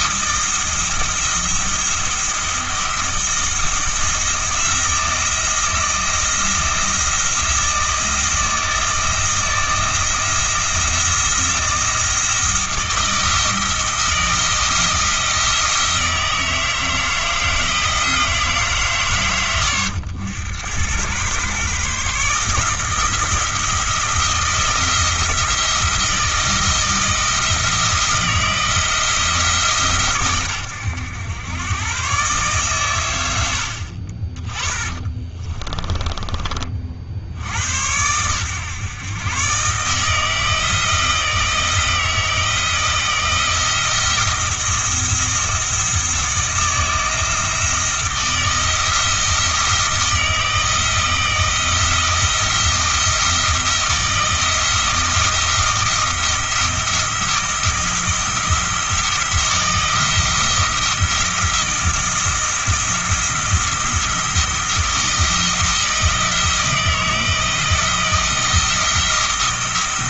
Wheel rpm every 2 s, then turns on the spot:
160, 170, 170, 160, 160, 170, 160, 170, 160, 150, 100, 160, 170, 170, 160, 110, 120, 20, 40, 120, 160, 160, 170, 160, 160, 160, 170, 160, 170, 170, 170, 170, 170, 160, 170.
34-36